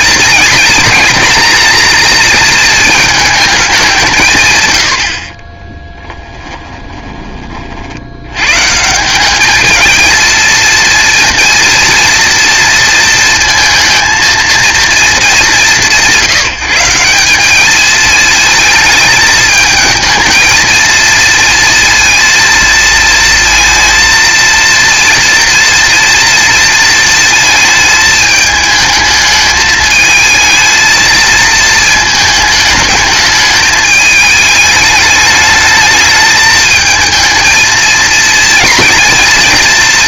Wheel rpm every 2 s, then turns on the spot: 230, 220, 90, 20, 160, 230, 230, 220, 170, 220, 230, 230, 230, 230, 220, 220, 210, 210, 220, 230.
6-8